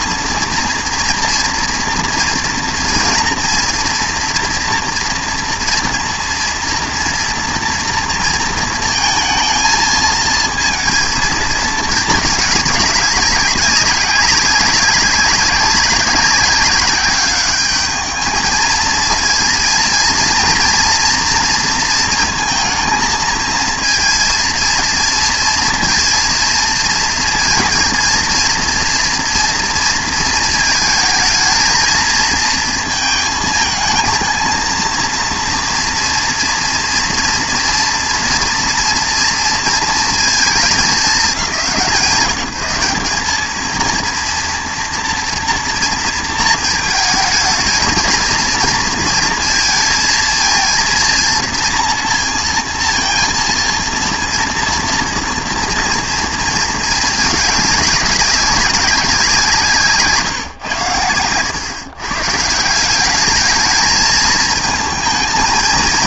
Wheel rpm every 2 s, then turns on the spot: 230, 230, 230, 230, 220, 230, 210, 190, 190, 220, 230, 220, 230, 230, 230, 220, 230, 230, 240, 230, 220, 190, 230, 220, 220, 230, 230, 230, 220, 190, 130, 170, 220.
none